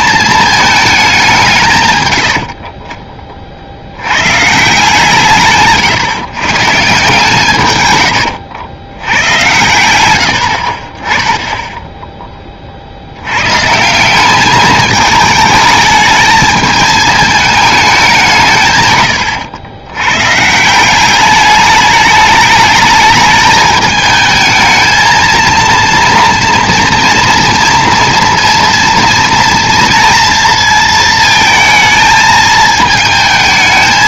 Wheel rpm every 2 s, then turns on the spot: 220, 50, 140, 140, 100, 50, 30, 210, 220, 140, 160, 210, 220, 230, 230, 230, 220.
none